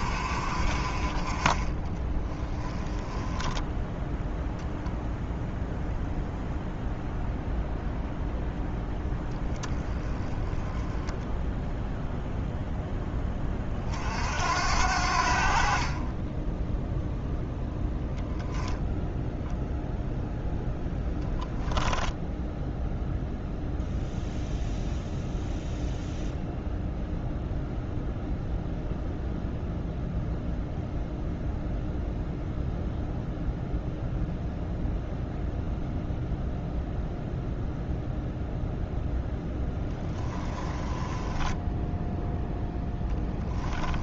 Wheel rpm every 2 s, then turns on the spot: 40, 10, 0, 0, 0, 10, 10, 70, 0, 0, 0, 0, 0, 0, 0, 0, 0, 0, 0, 0, 10, 10.
2-4 40-42